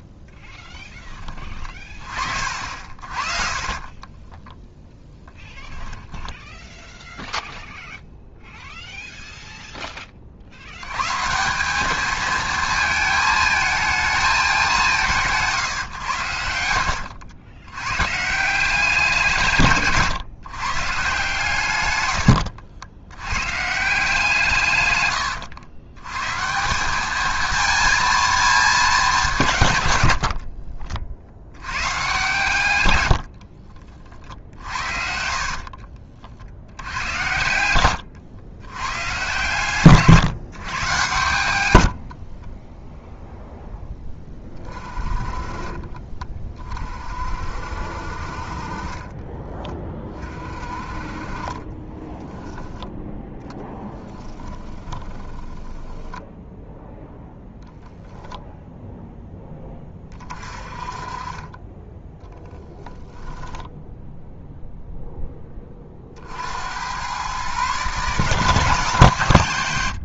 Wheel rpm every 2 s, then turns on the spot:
10, 50, 20, 10, 0, 60, 220, 200, 80, 180, 140, 80, 150, 150, 220, 40, 120, 50, 60, 110, 140, 30, 30, 30, 40, 40, 10, 10, 0, 0, 30, 0, 0, 80, 160.
4-8 16-18 30-32 42-44 54-56